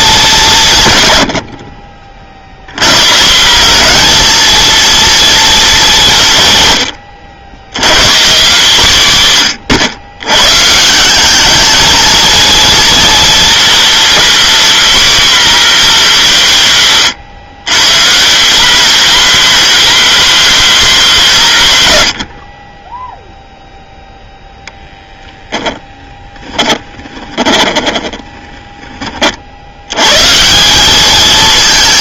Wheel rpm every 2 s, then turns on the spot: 170, 90, 230, 110, 170, 130, 230, 250, 180, 200, 230, 40, 0, 20, 10, 170.
26-28